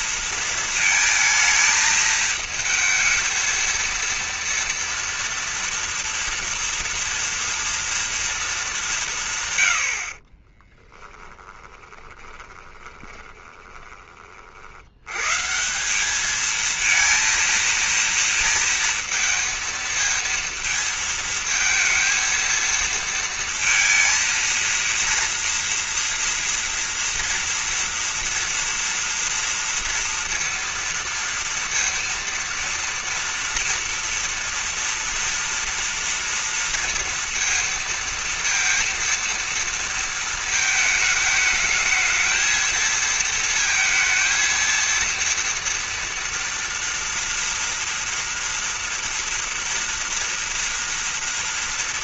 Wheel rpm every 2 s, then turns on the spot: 220, 230, 230, 230, 80, 20, 30, 190, 230, 230, 220, 230, 230, 230, 240, 230, 230, 230, 230, 230, 220, 220, 230, 230, 230, 230.
10-12